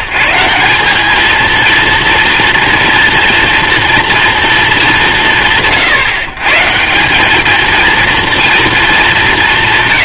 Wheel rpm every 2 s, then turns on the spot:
150, 230, 190, 150, 230.
none